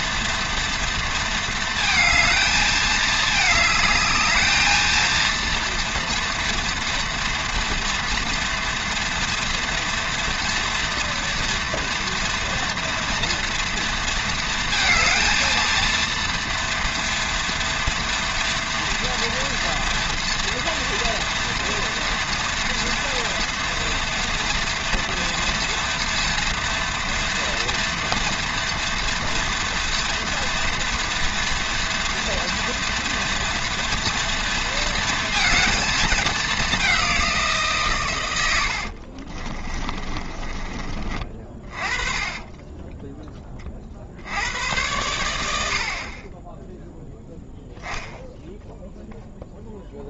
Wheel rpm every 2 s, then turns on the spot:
230, 210, 230, 230, 230, 230, 230, 220, 230, 240, 230, 230, 230, 230, 230, 230, 230, 230, 190, 60, 30, 20, 90, 0, 0.
38-44